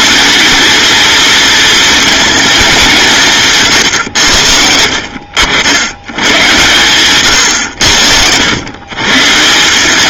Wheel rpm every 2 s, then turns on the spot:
230, 170, 70, 110, 150.
none